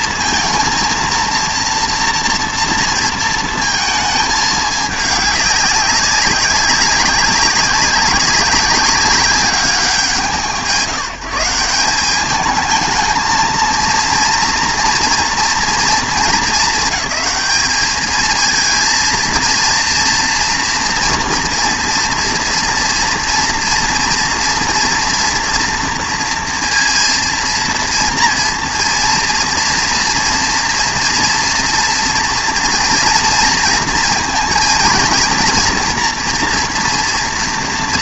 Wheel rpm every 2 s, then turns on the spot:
230, 230, 210, 190, 200, 160, 220, 230, 210, 230, 230, 230, 230, 230, 240, 230, 230, 230, 230.
none